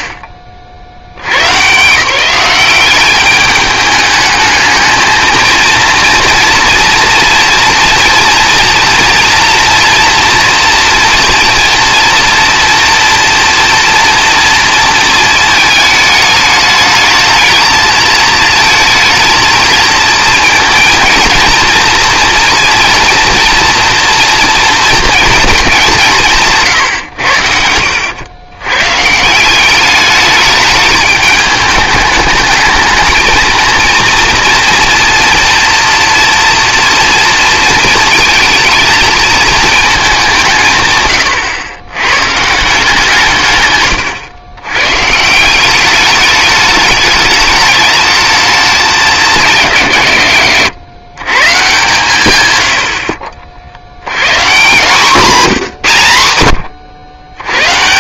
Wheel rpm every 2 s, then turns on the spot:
10, 170, 210, 230, 230, 230, 230, 230, 220, 220, 220, 230, 230, 180, 90, 200, 210, 230, 230, 220, 200, 120, 110, 210, 210, 140, 130, 130, 100.
44-46